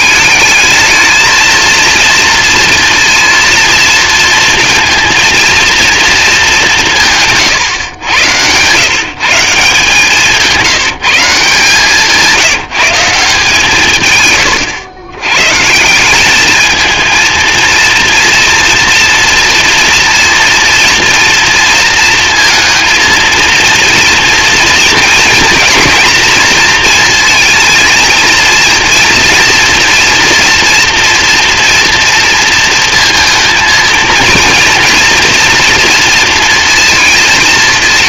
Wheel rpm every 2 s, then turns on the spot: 220, 230, 230, 170, 120, 170, 180, 100, 220, 230, 230, 230, 230, 230, 230, 240, 230, 230, 230.
none